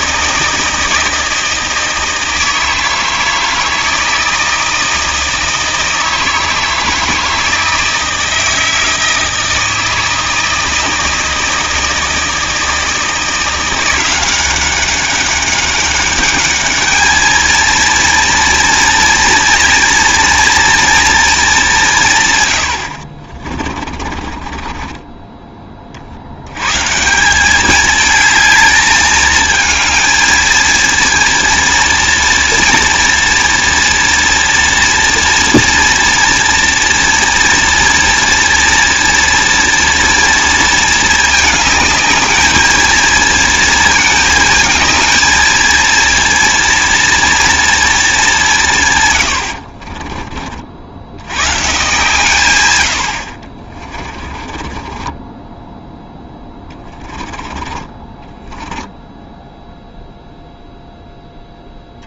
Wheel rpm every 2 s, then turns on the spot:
160, 160, 160, 160, 160, 160, 160, 190, 210, 230, 230, 100, 30, 120, 210, 230, 230, 230, 230, 230, 230, 220, 220, 230, 170, 50, 120, 30, 20, 10, 0.
22-26 54-60